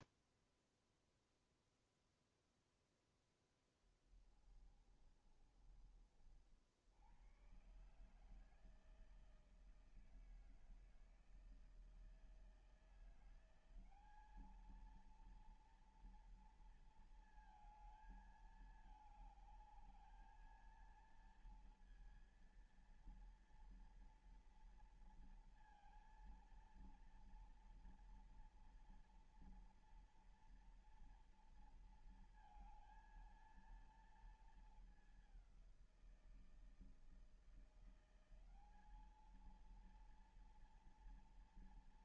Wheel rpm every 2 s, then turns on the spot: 0, 0, 30, 70, 160, 160, 170, 220, 230, 220, 220, 230, 230, 230, 240, 230, 220, 210, 160, 200, 230.
4-6